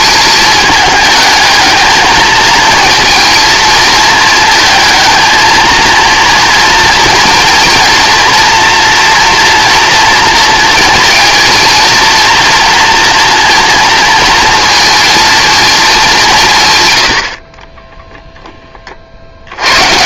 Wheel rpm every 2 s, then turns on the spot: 220, 220, 220, 230, 230, 230, 230, 230, 150, 30.
none